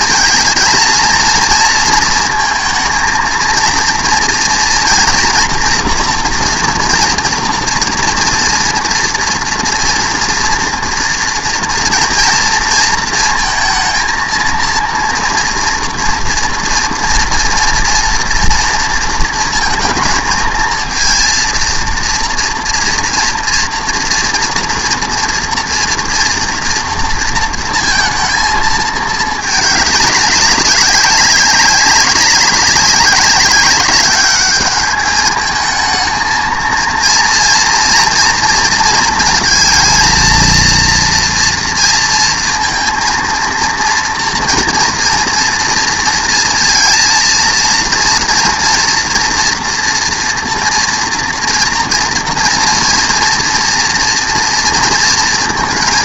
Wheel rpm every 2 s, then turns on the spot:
230, 230, 230, 230, 230, 230, 230, 230, 230, 230, 230, 230, 230, 240, 220, 200, 190, 210, 230, 230, 230, 230, 240, 230, 230, 240, 230, 230.
none